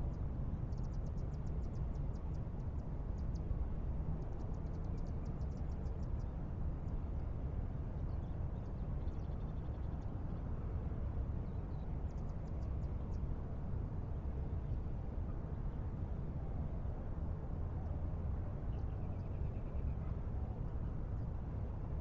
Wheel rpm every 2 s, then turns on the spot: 0, 0, 0, 0, 0, 0, 0, 0, 0, 0, 0.
none